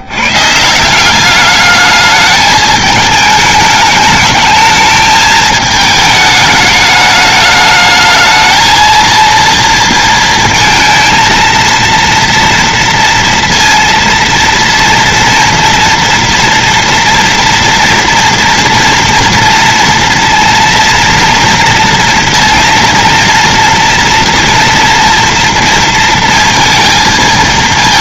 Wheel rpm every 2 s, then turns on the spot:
180, 210, 220, 210, 230, 230, 240, 230, 230, 230, 230, 230, 230, 220.
none